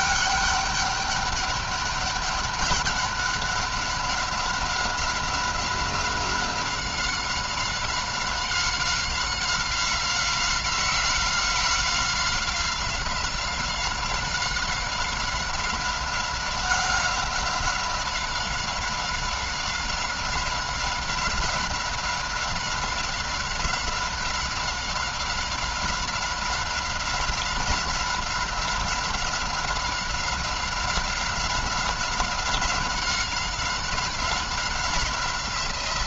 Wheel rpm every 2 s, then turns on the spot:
200, 200, 190, 190, 190, 190, 190, 190, 190, 190, 190, 190, 190, 180, 190, 190, 190, 180.
none